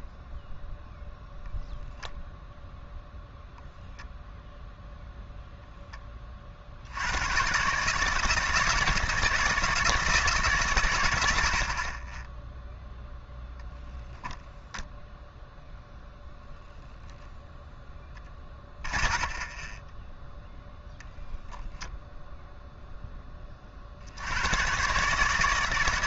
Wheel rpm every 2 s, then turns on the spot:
0, 0, 0, 40, 170, 130, 0, 0, 0, 30, 0, 0, 120.
18-20